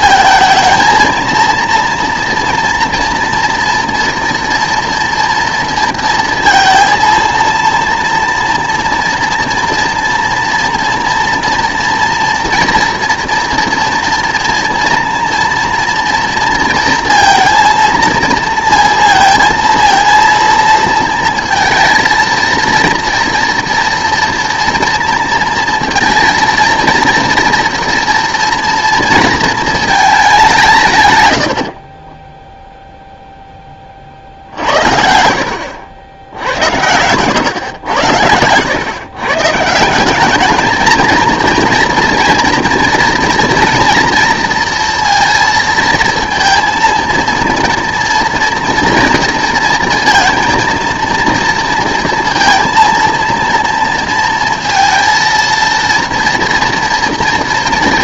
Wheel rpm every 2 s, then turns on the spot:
220, 240, 240, 230, 230, 230, 230, 230, 230, 230, 230, 230, 230, 230, 230, 160, 0, 60, 80, 110, 220, 230, 230, 230, 240, 230, 230, 230, 230.
none